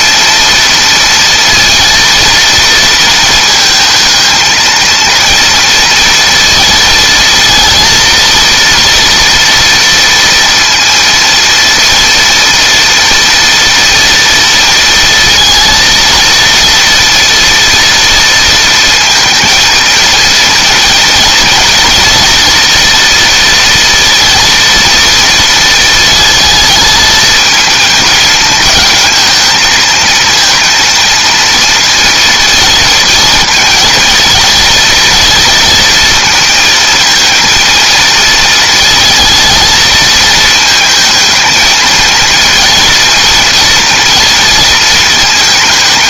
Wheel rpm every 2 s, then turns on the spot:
230, 230, 230, 220, 230, 230, 230, 230, 230, 230, 230, 230, 230, 220, 220, 230, 230, 240, 230, 230, 220, 230, 230.
none